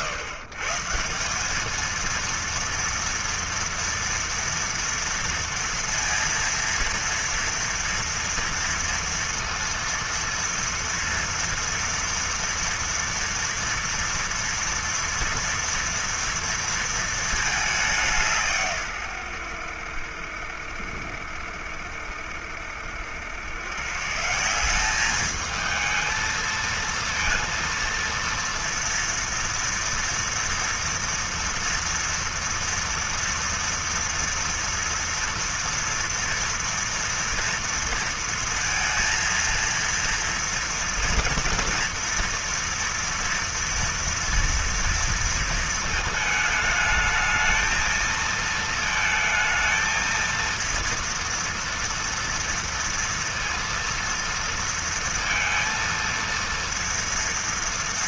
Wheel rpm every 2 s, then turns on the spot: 140, 230, 230, 230, 230, 230, 230, 230, 230, 140, 70, 70, 180, 230, 230, 230, 230, 230, 230, 230, 240, 230, 230, 220, 220, 230, 230, 230, 230.
none